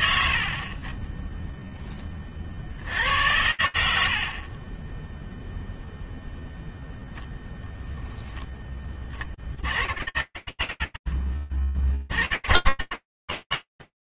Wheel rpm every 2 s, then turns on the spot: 10, 70, 0, 0, 110, 20, 130.
none